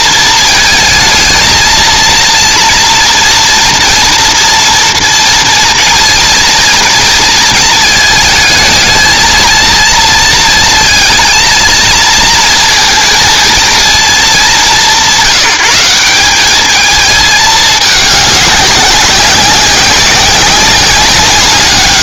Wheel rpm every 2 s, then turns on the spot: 230, 230, 230, 230, 220, 230, 230, 190, 200, 200, 190.
none